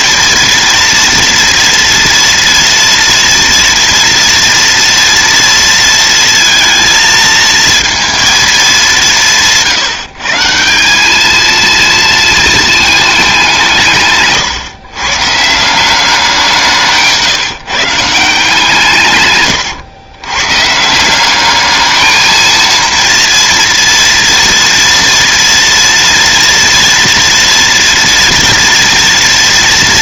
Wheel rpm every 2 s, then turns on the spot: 230, 230, 230, 230, 220, 170, 220, 130, 180, 160, 140, 230, 230, 230, 230.
none